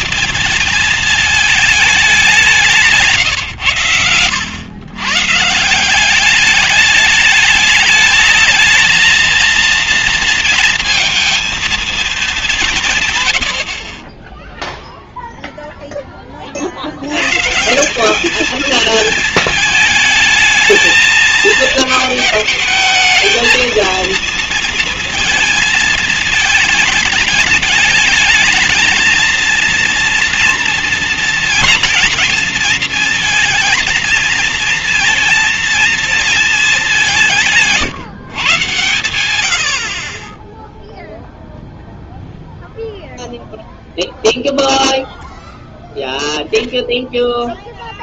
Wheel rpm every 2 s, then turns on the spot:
220, 160, 110, 210, 220, 230, 150, 0, 70, 220, 220, 220, 230, 210, 220, 230, 230, 230, 200, 110, 0, 0, 0, 0.
none